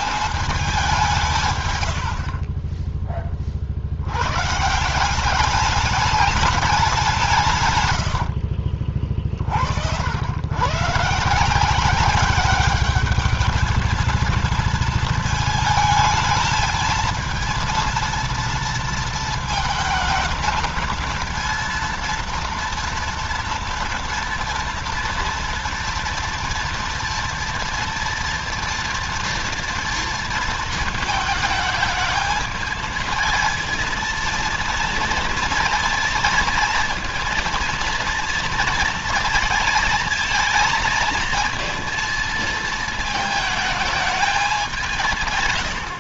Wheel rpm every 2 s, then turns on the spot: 200, 40, 150, 200, 50, 120, 200, 230, 220, 230, 220, 230, 230, 230, 230, 230, 220, 230, 230, 230, 230, 220, 190.
2-4 8-10